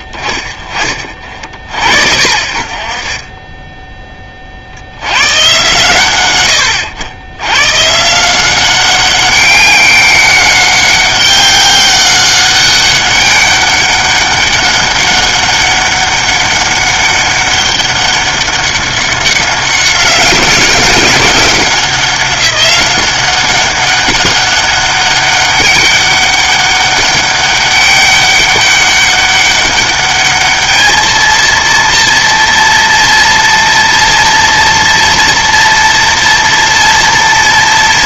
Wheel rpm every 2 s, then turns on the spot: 30, 50, 50, 90, 180, 190, 200, 200, 200, 200, 190, 190, 200, 200, 200, 210, 230, 230, 230.
none